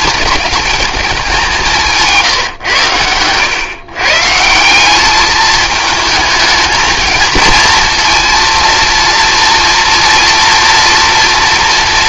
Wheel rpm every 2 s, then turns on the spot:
220, 120, 180, 220, 230, 230.
none